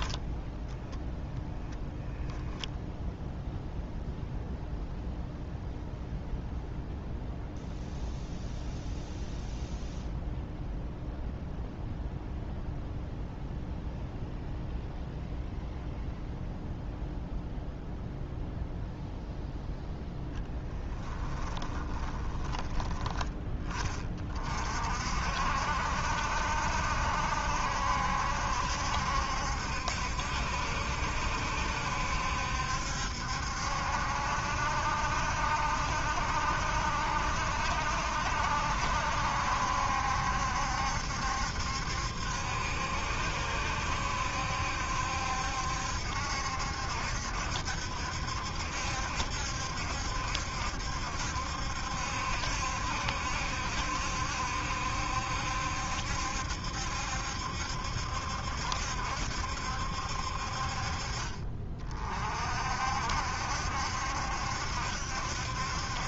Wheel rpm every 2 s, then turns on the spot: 10, 0, 0, 0, 0, 0, 0, 0, 0, 0, 10, 10, 50, 70, 70, 70, 70, 70, 70, 70, 70, 70, 70, 70, 70, 70, 70, 70, 70, 70, 30, 60, 70.
0-2 20-22